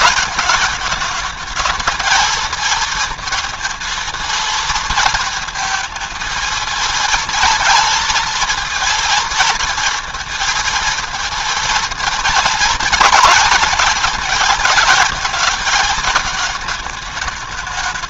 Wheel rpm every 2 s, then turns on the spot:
220, 230, 230, 230, 230, 230, 230, 230, 220.
none